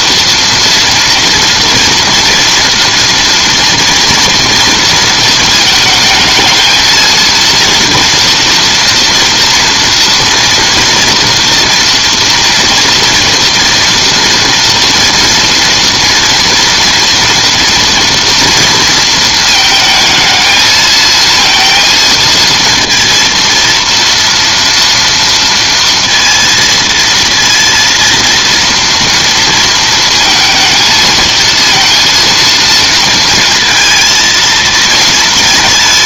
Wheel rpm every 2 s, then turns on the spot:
230, 230, 230, 220, 240, 230, 230, 230, 230, 230, 220, 230, 230, 230, 230, 220, 230, 220.
none